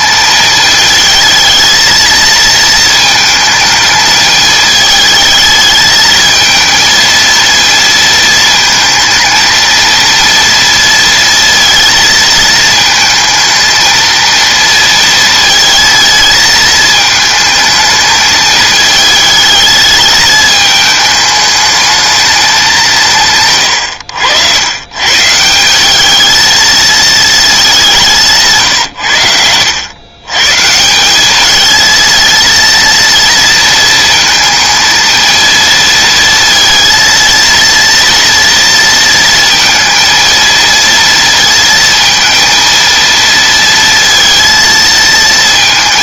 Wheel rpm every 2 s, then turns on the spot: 220, 220, 220, 220, 220, 230, 220, 230, 220, 220, 210, 180, 110, 220, 140, 150, 230, 230, 230, 230, 230, 230, 230.
28-30